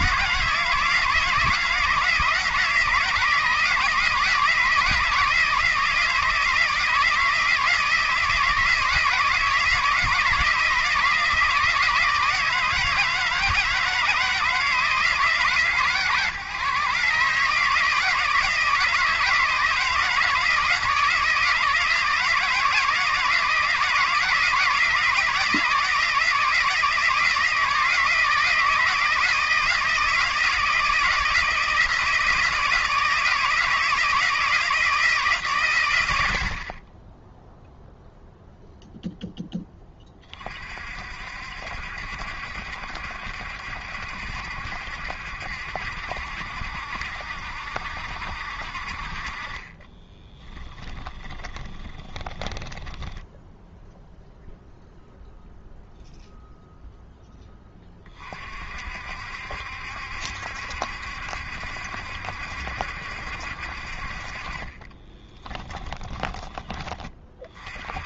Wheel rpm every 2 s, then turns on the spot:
160, 160, 160, 160, 160, 160, 160, 160, 140, 160, 160, 160, 160, 160, 160, 160, 160, 170, 40, 0, 50, 70, 70, 70, 50, 20, 10, 0, 0, 50, 70, 70, 30, 20.
50-54 64-66